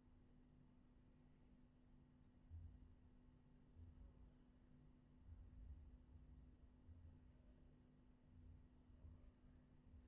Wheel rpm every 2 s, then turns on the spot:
0, 0, 0, 0, 0.
none